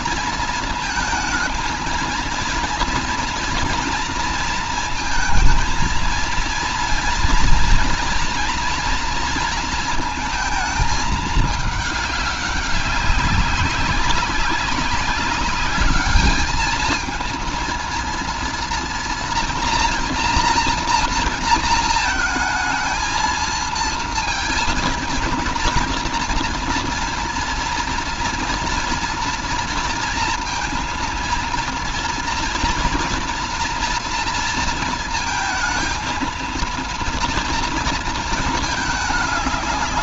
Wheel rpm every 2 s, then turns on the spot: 230, 230, 230, 230, 230, 220, 200, 200, 220, 230, 230, 230, 230, 230, 230, 230, 230, 230, 230, 220.
none